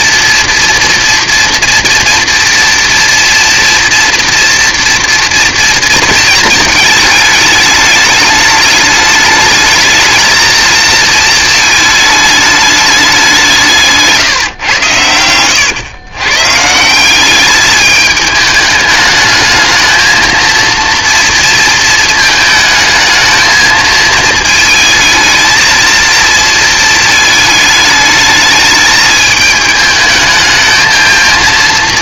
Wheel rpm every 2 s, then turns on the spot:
240, 230, 230, 220, 210, 220, 210, 120, 160, 210, 230, 220, 220, 220, 220, 220.
none